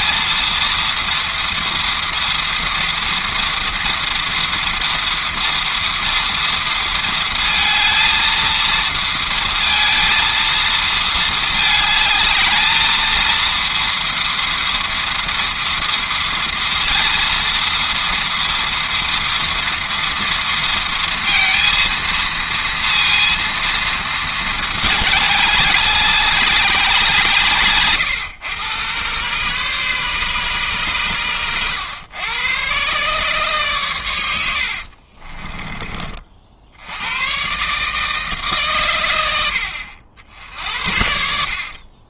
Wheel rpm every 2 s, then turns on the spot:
230, 230, 230, 230, 230, 220, 220, 230, 230, 230, 230, 230, 220, 200, 110, 130, 120, 60, 70, 130, 70.
34-36 40-42